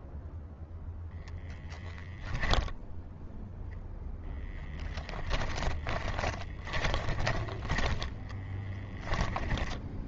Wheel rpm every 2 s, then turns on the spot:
0, 0, 10, 10, 10.
4-10